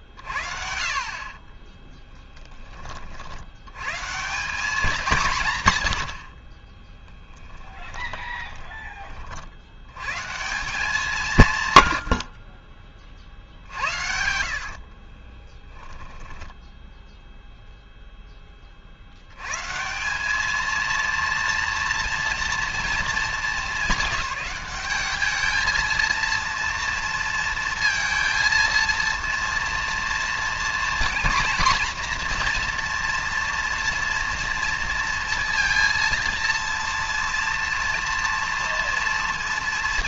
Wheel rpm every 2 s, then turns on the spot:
50, 20, 200, 20, 30, 170, 40, 70, 10, 20, 220, 230, 210, 230, 230, 240, 240, 230, 230, 230.
6-8 14-18